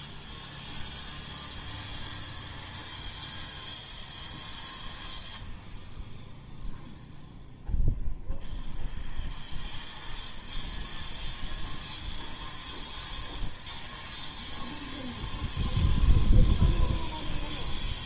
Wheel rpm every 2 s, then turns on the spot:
0, 0, 0, 0, 0, 0, 0, 0, 0.
none